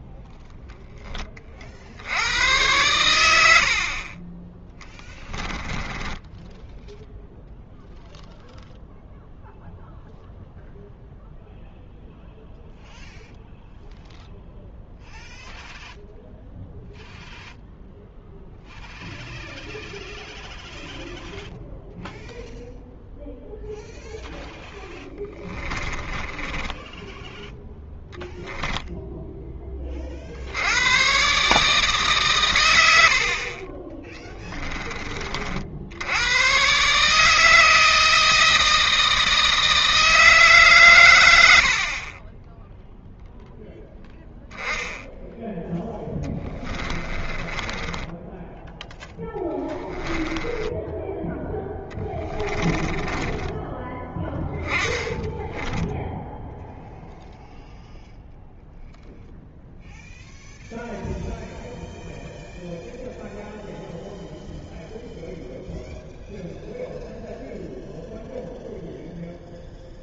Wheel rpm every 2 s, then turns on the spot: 10, 110, 10, 0, 0, 0, 0, 0, 0, 0, 0, 0, 10, 10, 0, 100, 100, 20, 140, 160, 130, 0, 10, 20, 10, 10, 20, 10, 0, 0, 0, 0, 0, 0, 0.
4-6 24-28 46-56